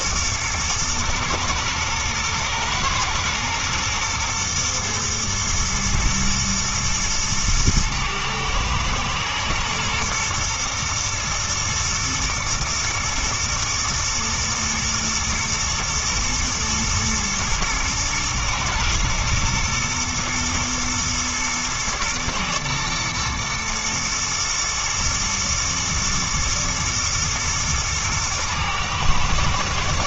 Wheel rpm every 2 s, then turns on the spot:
110, 110, 110, 120, 110, 120, 110, 120, 120, 110, 110, 110, 120, 110, 110.
none